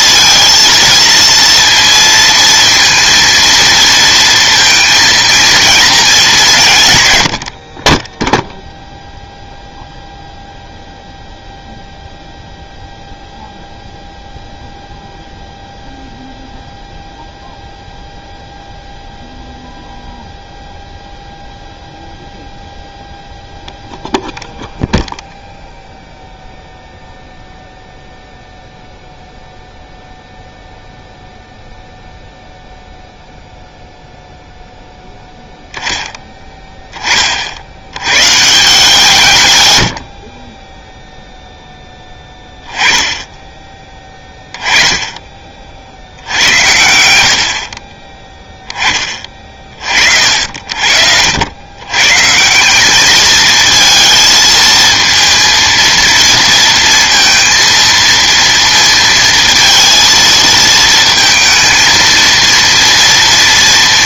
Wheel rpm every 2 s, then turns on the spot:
230, 230, 230, 190, 0, 0, 0, 0, 0, 0, 0, 0, 0, 0, 0, 0, 0, 0, 10, 150, 20, 10, 10, 80, 10, 60, 170, 230, 230, 230, 230, 230.
40-42